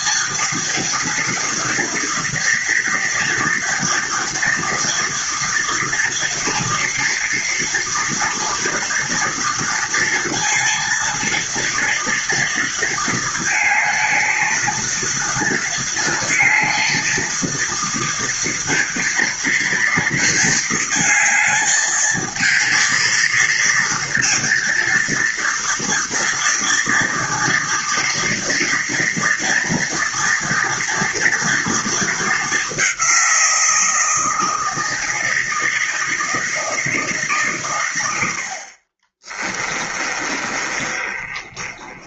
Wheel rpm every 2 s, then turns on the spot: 230, 230, 230, 240, 230, 230, 230, 230, 230, 230, 220, 230, 230, 230, 230, 230, 190, 160, 160, 40, 30.
38-42